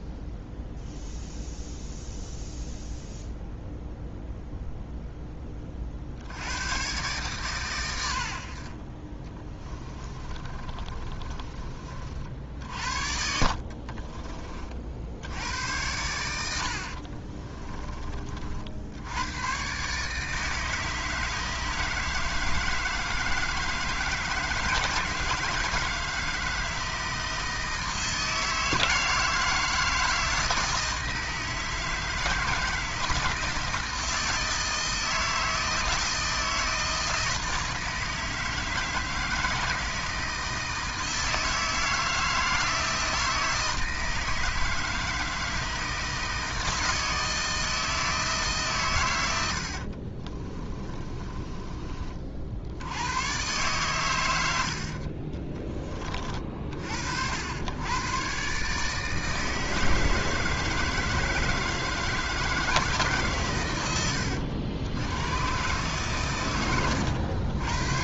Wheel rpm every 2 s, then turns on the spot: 0, 0, 0, 110, 40, 30, 50, 50, 70, 70, 160, 160, 160, 160, 160, 160, 160, 160, 160, 160, 160, 160, 160, 160, 130, 20, 80, 70, 50, 150, 160, 150, 100, 100.
10-12 16-18 50-52 54-56